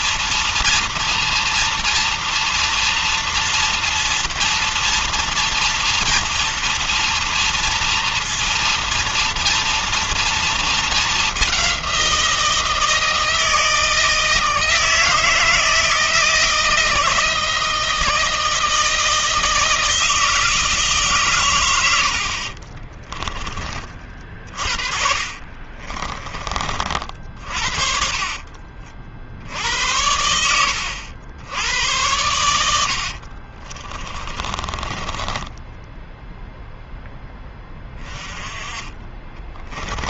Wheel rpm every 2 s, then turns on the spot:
230, 230, 230, 230, 230, 230, 180, 160, 160, 160, 160, 60, 30, 30, 40, 90, 90, 20, 0, 20.
22-24 28-30 34-36